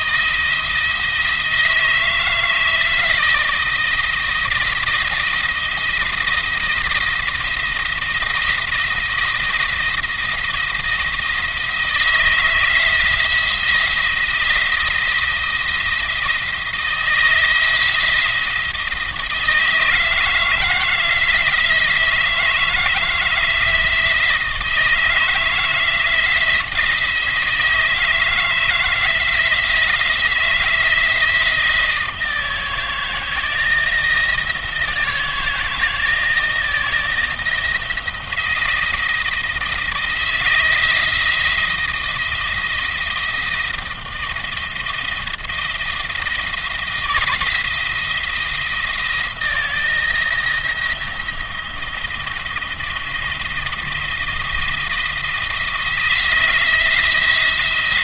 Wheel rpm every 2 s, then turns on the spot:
160, 160, 170, 170, 170, 160, 170, 170, 160, 170, 160, 160, 160, 160, 160, 160, 160, 170, 170, 170, 160, 160, 160, 170, 170, 160, 170, 170, 170.
none